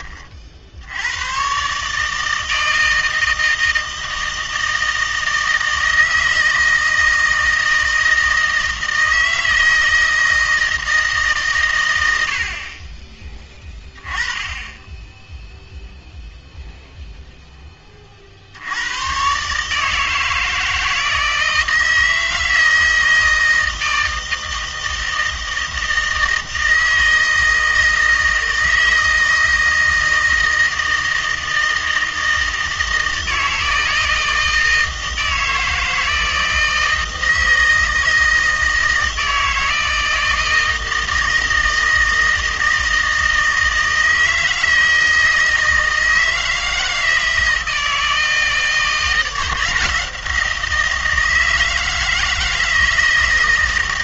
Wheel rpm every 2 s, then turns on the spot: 60, 160, 160, 160, 160, 160, 40, 10, 0, 80, 160, 160, 160, 160, 160, 160, 160, 160, 160, 160, 160, 160, 160, 160, 160, 170, 160.
none